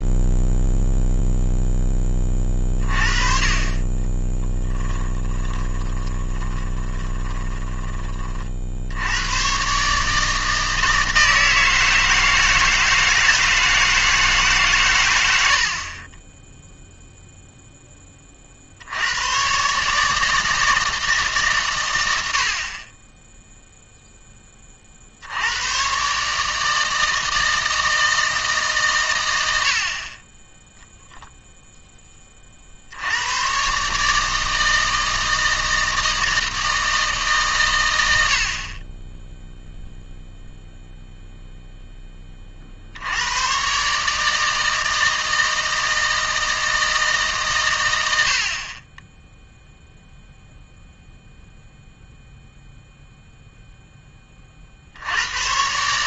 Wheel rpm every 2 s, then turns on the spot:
0, 30, 10, 20, 70, 160, 160, 130, 0, 60, 160, 30, 40, 160, 150, 0, 60, 160, 160, 40, 0, 50, 160, 160, 30, 0, 0, 50.
4-8